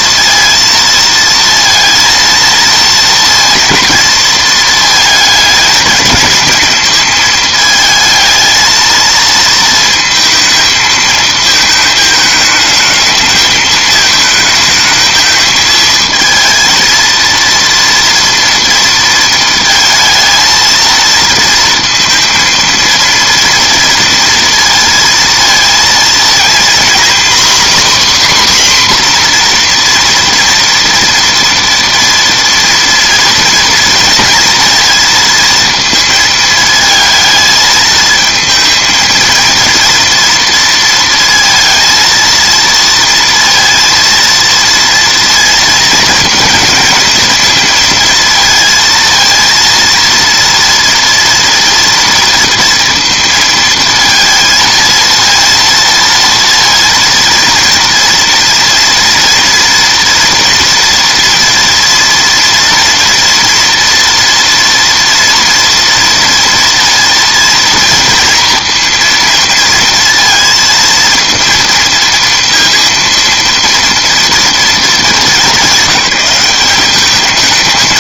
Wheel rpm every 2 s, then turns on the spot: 230, 230, 220, 220, 220, 220, 220, 220, 230, 230, 230, 230, 230, 240, 260, 240, 240, 230, 220, 230, 230, 230, 230, 230, 230, 230, 230, 230, 230, 240, 240, 230, 230, 230, 230, 230, 230, 220, 200.
none